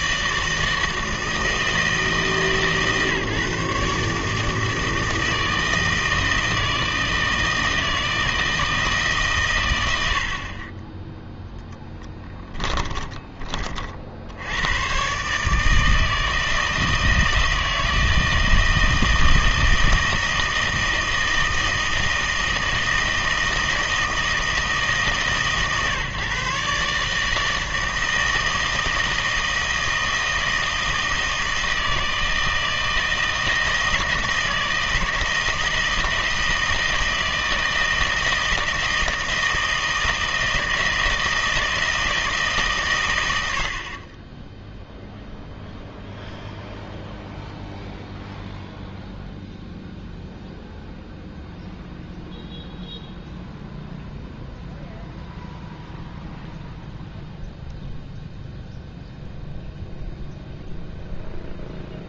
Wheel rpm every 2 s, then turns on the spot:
160, 150, 160, 160, 160, 20, 10, 110, 160, 160, 160, 160, 160, 150, 160, 160, 160, 160, 160, 160, 160, 140, 0, 0, 0, 0, 0, 0, 0, 0, 0.
12-14